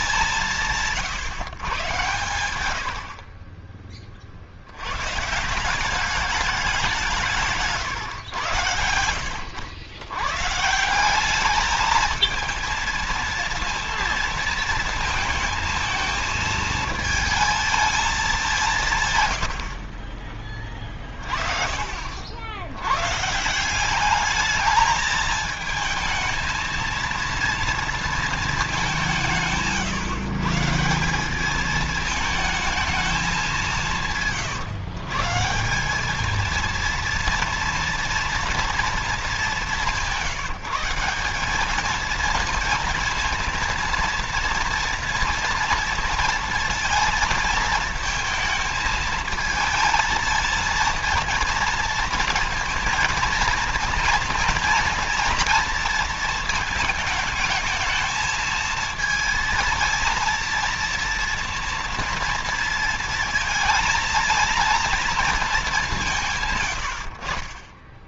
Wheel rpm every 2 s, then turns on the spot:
150, 70, 100, 190, 90, 180, 230, 230, 220, 160, 30, 110, 220, 230, 190, 170, 220, 130, 230, 220, 180, 230, 230, 230, 220, 230, 230, 230, 220, 230, 230, 230, 230, 80.
none